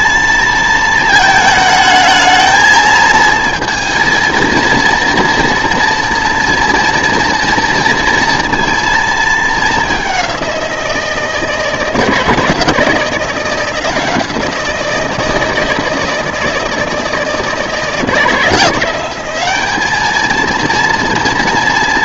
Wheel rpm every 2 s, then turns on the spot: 230, 220, 230, 230, 230, 180, 170, 170, 160, 180, 230.
none